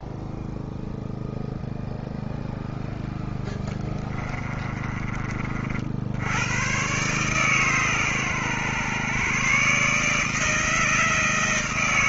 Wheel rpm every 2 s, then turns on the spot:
0, 0, 20, 60, 130, 150.
4-6